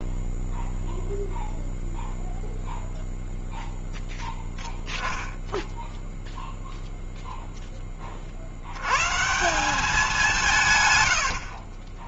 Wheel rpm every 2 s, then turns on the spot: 0, 0, 10, 0, 60, 150.
none